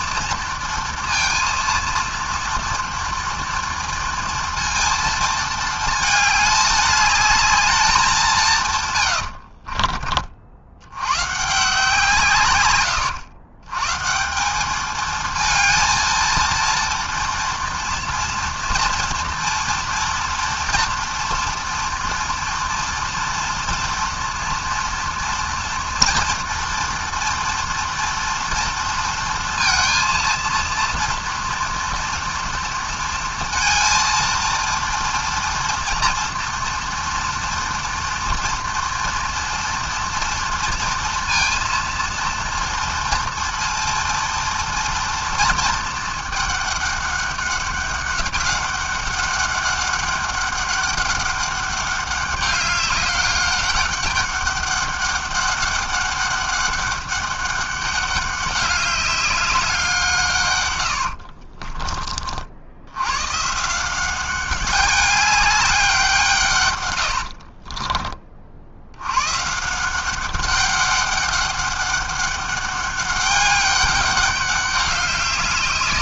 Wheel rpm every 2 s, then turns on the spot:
230, 240, 230, 210, 90, 130, 110, 220, 230, 230, 230, 230, 230, 230, 230, 230, 230, 230, 230, 230, 230, 230, 230, 200, 200, 200, 200, 200, 200, 200, 60, 120, 200, 80, 130, 200, 200, 200.
8-10 60-62 66-68